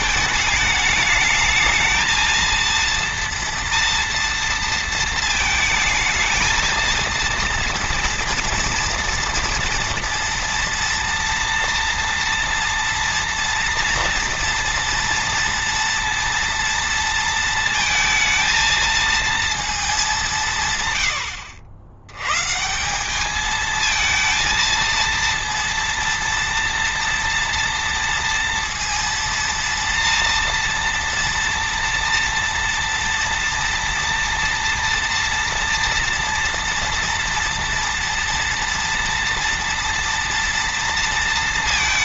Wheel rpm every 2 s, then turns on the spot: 220, 230, 230, 220, 230, 230, 240, 230, 230, 230, 160, 130, 230, 230, 230, 230, 230, 230, 230, 230, 230.
none